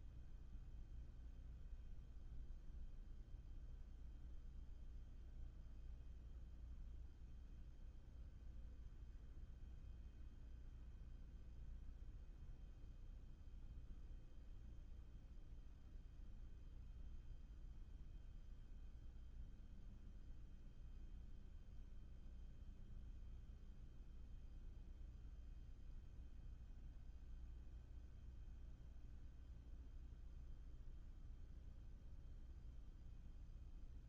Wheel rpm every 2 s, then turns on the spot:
0, 0, 0, 0, 0, 0, 0, 0, 0, 0, 0, 0, 0, 0, 0, 0, 0.
none